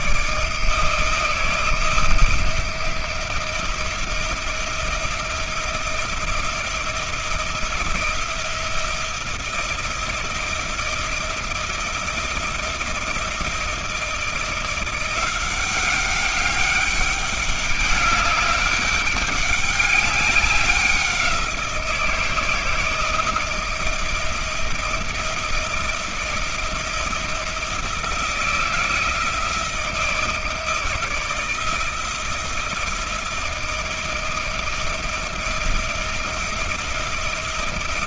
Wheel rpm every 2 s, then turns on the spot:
160, 170, 170, 160, 170, 160, 170, 170, 200, 200, 190, 170, 170, 170, 160, 160, 160, 170, 170.
none